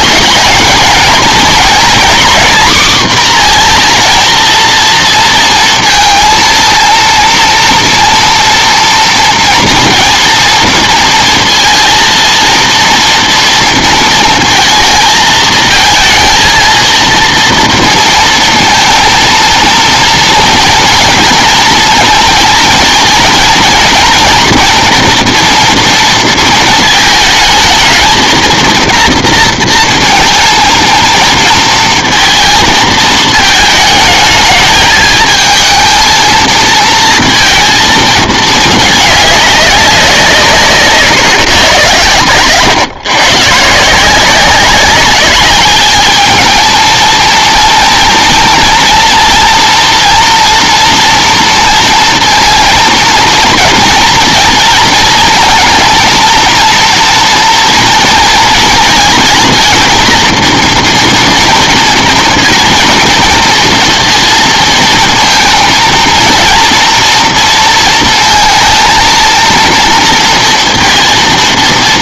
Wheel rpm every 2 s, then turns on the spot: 220, 250, 230, 230, 230, 230, 230, 230, 230, 230, 230, 220, 230, 220, 230, 230, 220, 220, 220, 210, 160, 130, 190, 220, 230, 240, 230, 230, 230, 230, 230, 230, 230, 230, 230, 230.
none